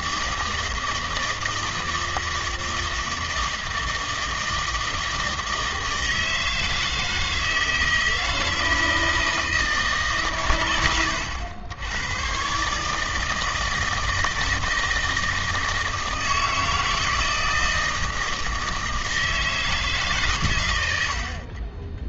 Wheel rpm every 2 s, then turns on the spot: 160, 160, 160, 160, 160, 100, 140, 160, 160, 160, 100.
none